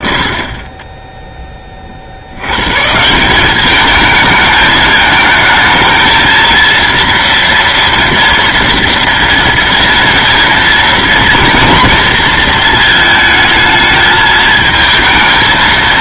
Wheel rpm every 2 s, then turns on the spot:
30, 150, 220, 230, 230, 230, 220, 220.
none